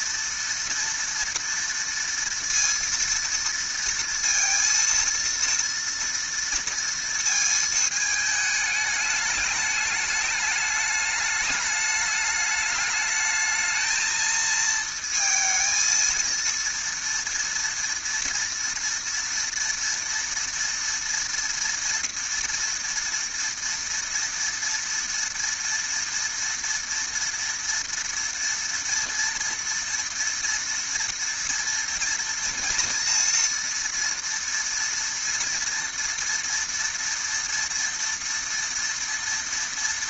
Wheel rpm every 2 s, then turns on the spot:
230, 230, 230, 230, 220, 210, 210, 220, 230, 230, 230, 240, 230, 230, 230, 230, 230, 230, 240, 230.
none